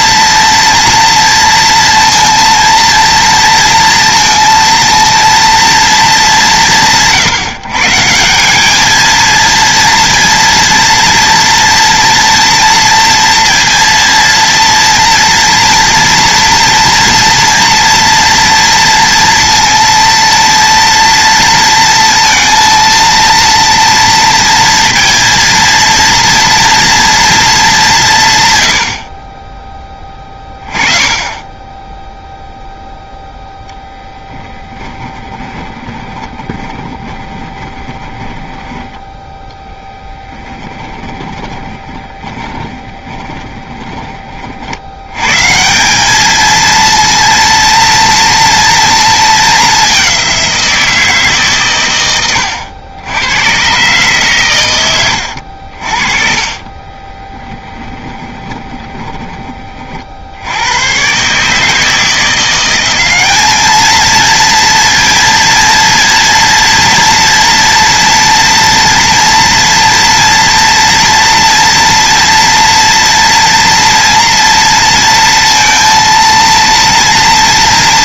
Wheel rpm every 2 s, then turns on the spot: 230, 230, 230, 160, 220, 230, 230, 240, 230, 230, 230, 230, 230, 230, 60, 20, 0, 30, 20, 10, 20, 20, 90, 230, 220, 170, 90, 100, 20, 20, 110, 190, 230, 230, 230, 230, 230, 230, 230.
34-38 40-44 54-60